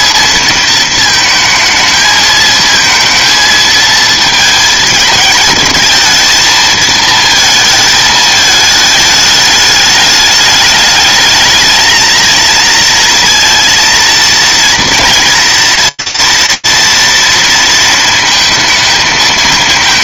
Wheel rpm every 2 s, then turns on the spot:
220, 220, 220, 230, 220, 210, 220, 230, 230, 230.
none